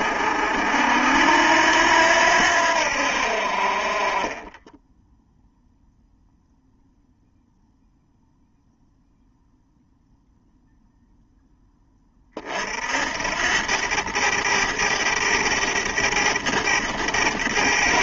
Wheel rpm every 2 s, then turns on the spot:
70, 70, 10, 0, 0, 0, 70, 100, 100.
4-6